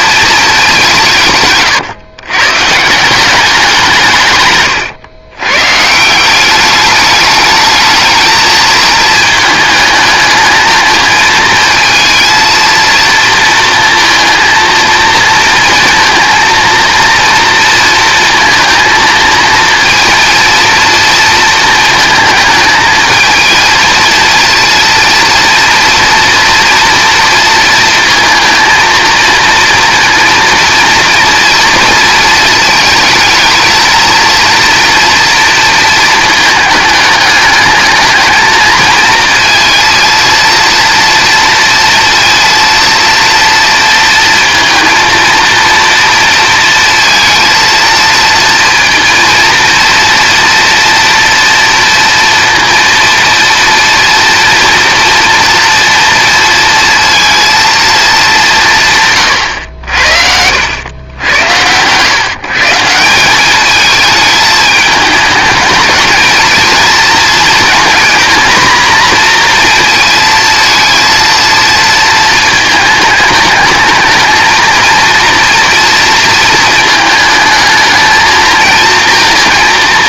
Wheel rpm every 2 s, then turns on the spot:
160, 170, 110, 200, 220, 220, 230, 230, 230, 230, 230, 220, 230, 230, 230, 230, 230, 240, 220, 220, 230, 230, 230, 230, 230, 240, 230, 240, 230, 140, 90, 170, 210, 230, 230, 230, 220, 230, 220, 230.
none